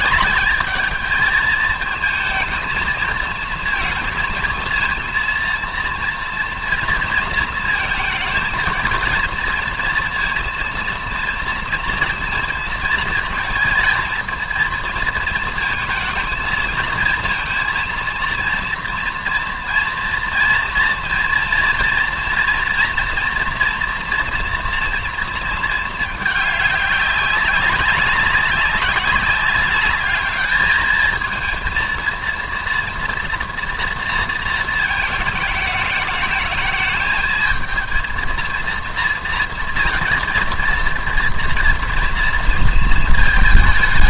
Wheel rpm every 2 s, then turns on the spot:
220, 230, 230, 230, 230, 230, 220, 230, 230, 230, 230, 230, 230, 200, 190, 220, 230, 220, 220, 230, 230, 230.
none